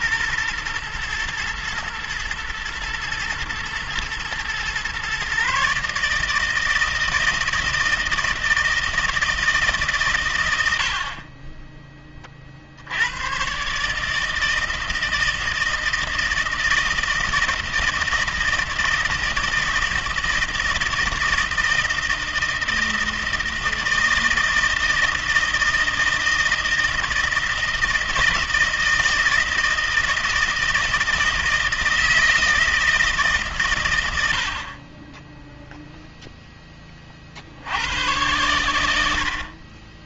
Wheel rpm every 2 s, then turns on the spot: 120, 120, 120, 160, 160, 100, 50, 160, 160, 160, 160, 160, 160, 160, 160, 160, 160, 70, 10, 100.
none